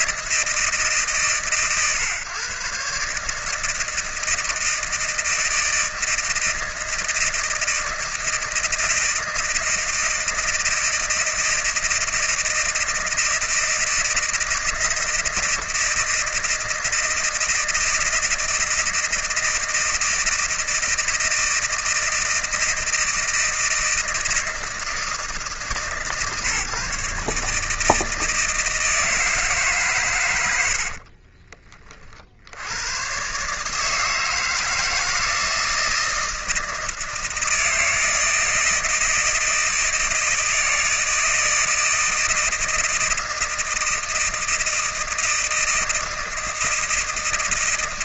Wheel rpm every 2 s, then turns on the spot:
160, 140, 160, 160, 160, 160, 160, 160, 160, 160, 160, 160, 160, 150, 160, 70, 100, 160, 160, 160, 160, 160, 160, 160.
none